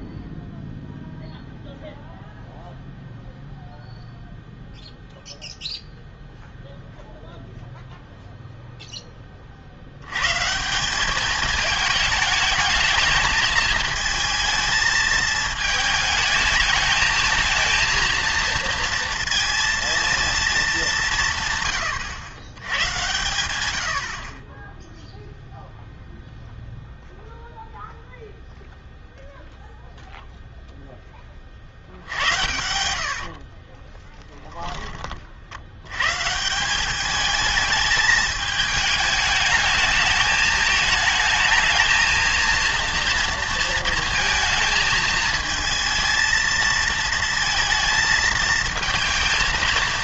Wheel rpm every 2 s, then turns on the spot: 0, 0, 0, 0, 0, 160, 210, 220, 220, 230, 210, 110, 10, 0, 0, 0, 80, 20, 170, 220, 220, 230, 220, 230, 230.
32-34